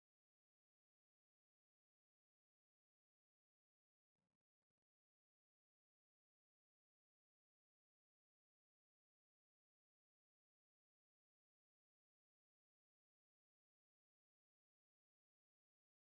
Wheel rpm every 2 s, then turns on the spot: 0, 0, 0, 0, 0, 0, 0, 0.
none